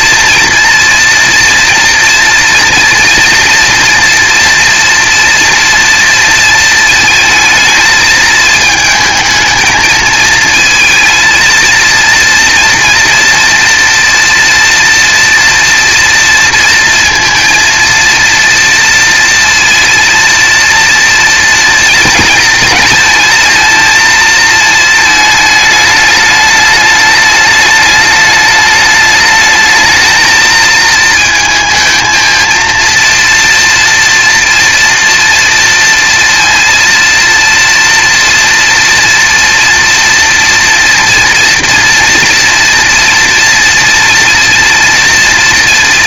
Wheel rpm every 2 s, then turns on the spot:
240, 230, 230, 220, 220, 230, 230, 230, 230, 230, 230, 220, 220, 210, 220, 220, 230, 230, 230, 230, 230, 230, 230.
none